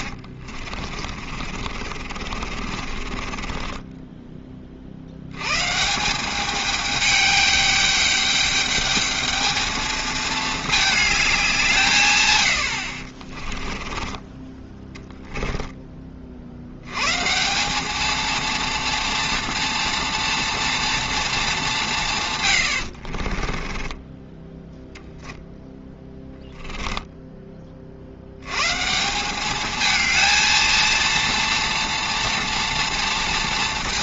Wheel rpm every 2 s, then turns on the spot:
50, 40, 40, 210, 210, 220, 80, 20, 80, 230, 230, 90, 10, 20, 140, 230, 230.
0-4 26-28